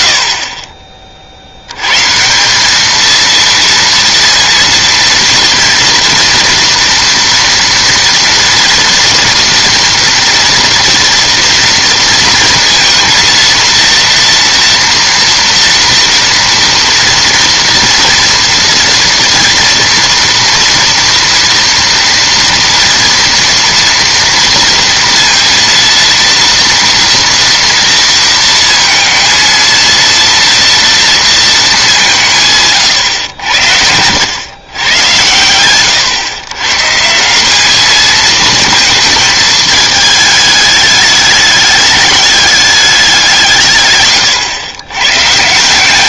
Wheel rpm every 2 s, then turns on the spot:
40, 210, 230, 230, 230, 230, 230, 230, 230, 230, 230, 230, 230, 240, 230, 230, 140, 110, 130, 220, 210, 200, 110.
none